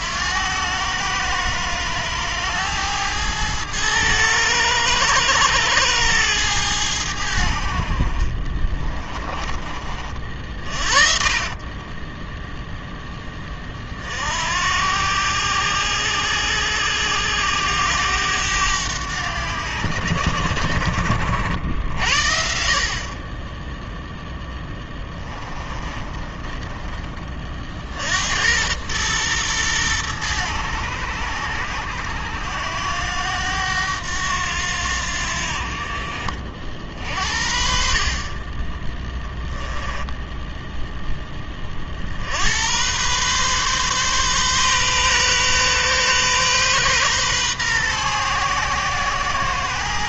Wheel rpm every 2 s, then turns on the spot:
100, 110, 110, 100, 40, 50, 0, 80, 90, 100, 70, 60, 10, 20, 100, 100, 90, 80, 50, 20, 0, 90, 130, 130, 120.
8-12 24-28